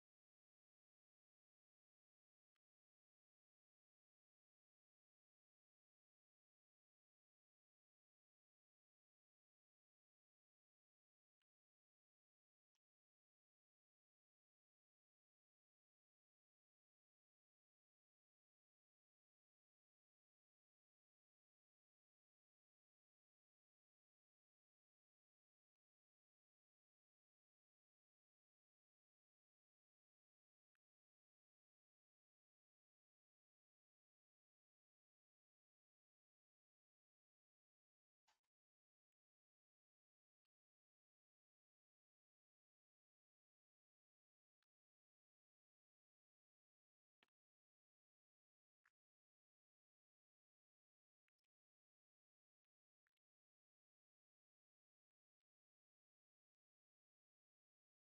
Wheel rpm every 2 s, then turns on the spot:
0, 0, 0, 0, 0, 0, 0, 0, 0, 0, 0, 0, 0, 0, 0, 0, 0, 0, 0, 0, 0, 0, 0, 0, 0, 0, 0, 0, 0.
none